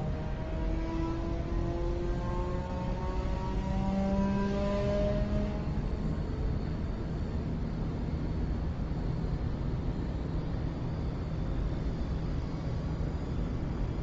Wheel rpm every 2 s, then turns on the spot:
0, 0, 0, 0, 0, 0, 0.
none